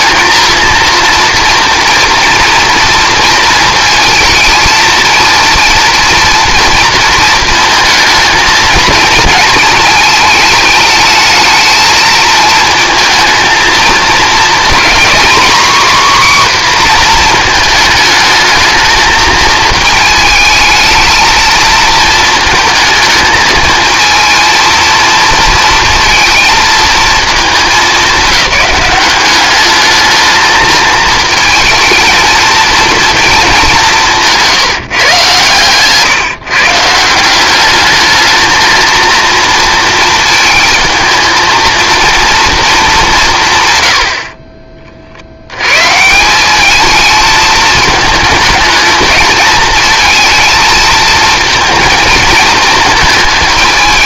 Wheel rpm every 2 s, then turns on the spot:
230, 230, 230, 230, 220, 220, 220, 240, 260, 220, 220, 220, 230, 230, 200, 220, 230, 170, 150, 220, 220, 220, 30, 210, 220, 220, 220.
none